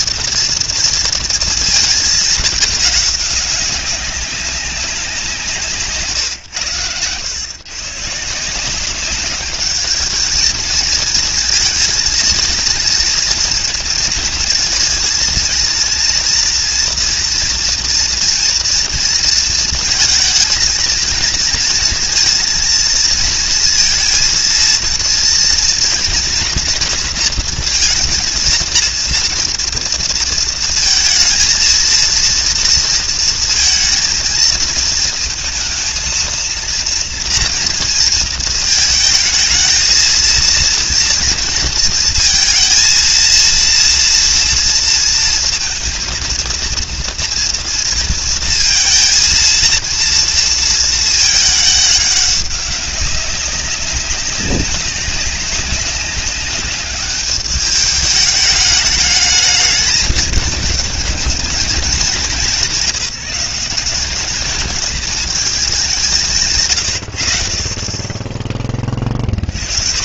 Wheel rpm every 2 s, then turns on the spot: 230, 210, 190, 110, 180, 220, 230, 230, 230, 230, 220, 230, 230, 230, 230, 220, 230, 220, 230, 220, 230, 230, 230, 230, 230, 230, 190, 200, 200, 210, 220, 190, 220, 110, 30.
none